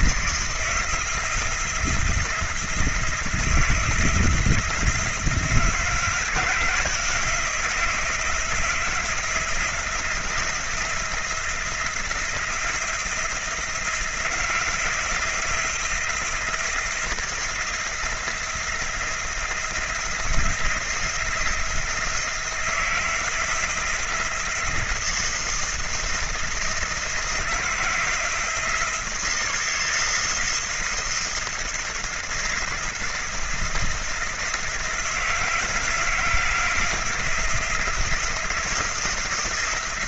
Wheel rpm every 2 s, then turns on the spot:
160, 170, 160, 170, 160, 170, 160, 170, 170, 170, 170, 170, 170, 160, 170, 170, 170, 170, 160, 170.
none